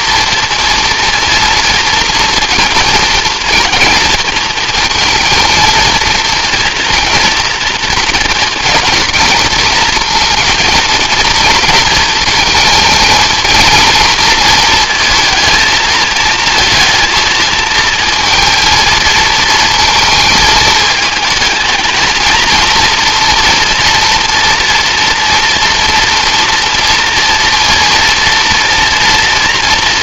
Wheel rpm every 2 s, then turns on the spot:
230, 230, 230, 230, 240, 220, 230, 220, 230, 230, 220, 230, 230, 230, 230.
none